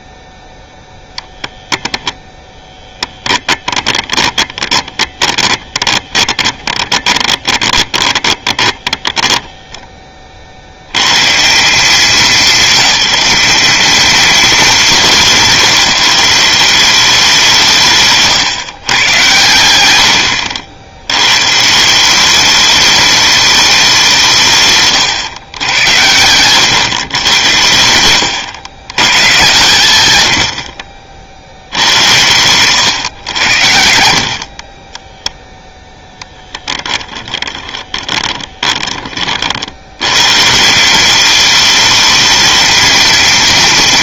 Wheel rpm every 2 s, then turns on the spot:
0, 10, 20, 20, 20, 100, 210, 210, 190, 130, 80, 210, 140, 110, 120, 60, 120, 30, 10, 20, 160, 220.
2-10 24-26 32-40